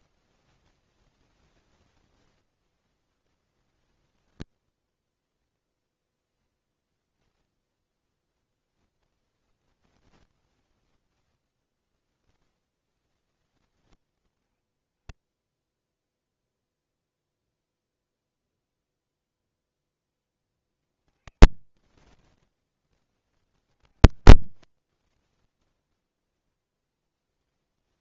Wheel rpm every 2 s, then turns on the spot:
0, 30, 10, 0, 0, 0, 0, 10, 0, 0, 20, 10, 30, 0.
24-26